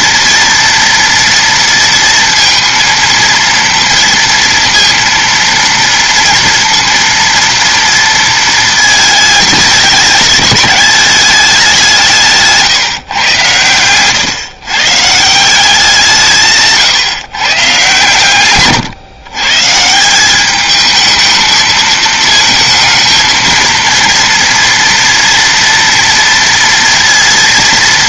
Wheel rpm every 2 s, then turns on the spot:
230, 230, 230, 230, 210, 200, 120, 160, 130, 120, 220, 220, 230, 240.
none